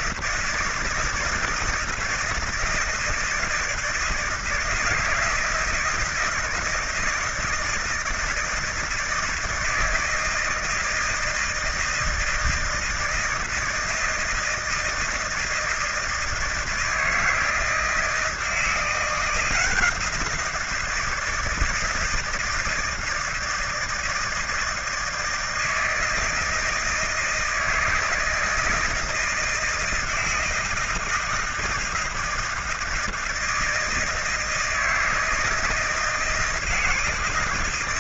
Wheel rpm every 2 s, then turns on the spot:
160, 160, 160, 160, 160, 160, 160, 160, 160, 170, 170, 160, 160, 160, 160, 160, 160, 160, 160.
none